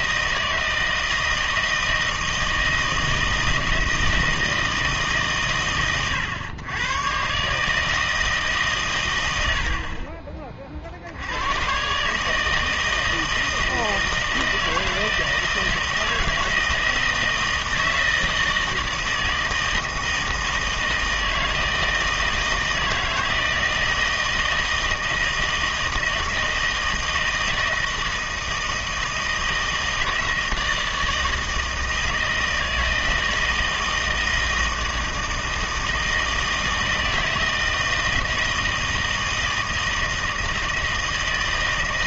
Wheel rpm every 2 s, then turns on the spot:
160, 160, 160, 100, 150, 30, 150, 160, 160, 160, 160, 160, 160, 160, 160, 160, 160, 160, 160, 160, 160.
none